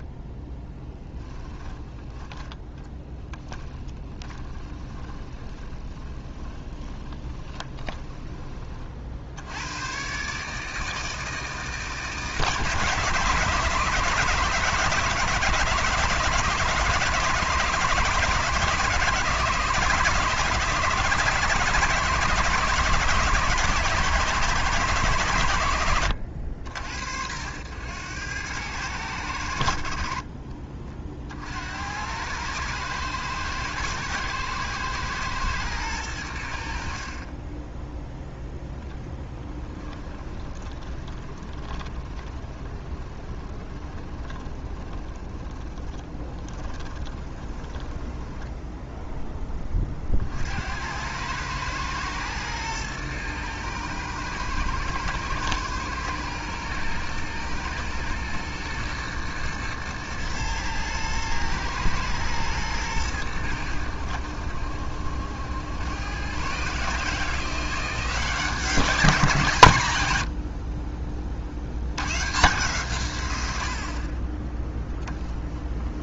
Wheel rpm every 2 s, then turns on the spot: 10, 10, 20, 20, 50, 160, 140, 160, 170, 150, 160, 170, 160, 80, 100, 40, 110, 110, 60, 10, 20, 20, 20, 20, 0, 90, 110, 110, 120, 110, 110, 110, 70, 140, 180, 40, 140, 10.
0-8 40-48 74-76